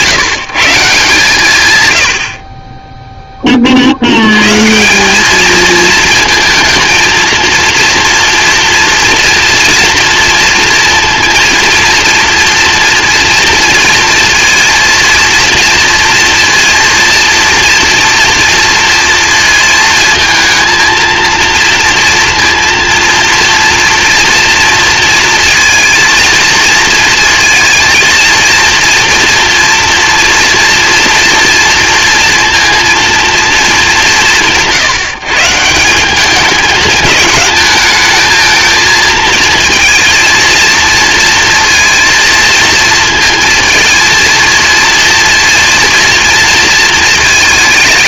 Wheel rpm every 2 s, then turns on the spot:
160, 30, 140, 220, 230, 230, 230, 230, 230, 230, 220, 230, 230, 230, 230, 240, 230, 160, 210, 220, 230, 230, 230, 230.
none